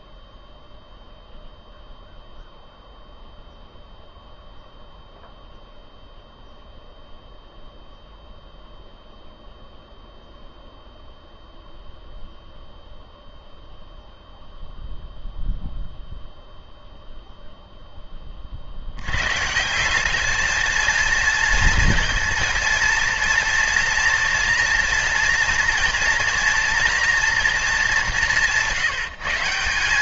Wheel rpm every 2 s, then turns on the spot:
0, 0, 0, 0, 0, 0, 0, 0, 0, 80, 230, 230, 230, 240, 150.
none